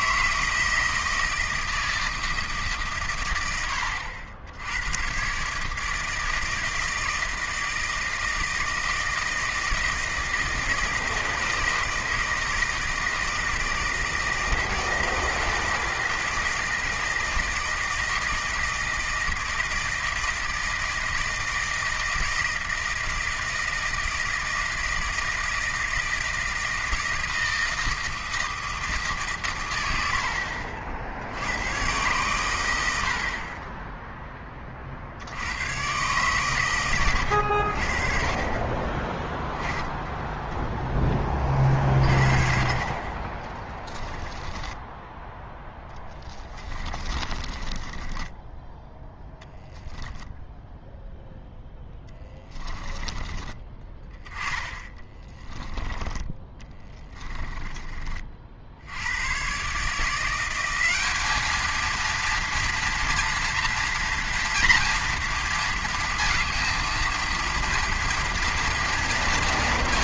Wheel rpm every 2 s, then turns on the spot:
160, 150, 90, 160, 160, 160, 160, 160, 160, 160, 160, 160, 160, 160, 160, 60, 100, 40, 110, 20, 10, 50, 10, 30, 20, 0, 20, 10, 20, 70, 190, 230, 230, 230, 230.
44-50 52-58